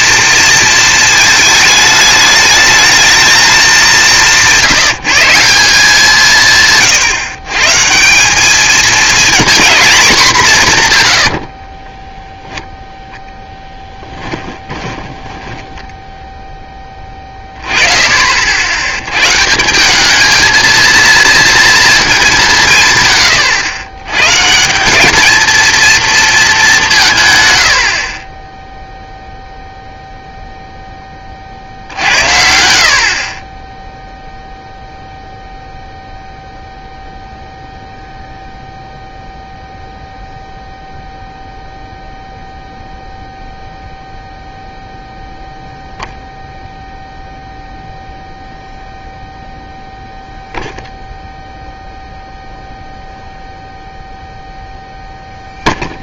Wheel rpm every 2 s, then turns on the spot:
230, 220, 180, 150, 210, 180, 0, 10, 20, 90, 230, 170, 160, 190, 0, 0, 70, 0, 0, 0, 0, 0, 0, 0, 0, 0, 0, 0.
14-16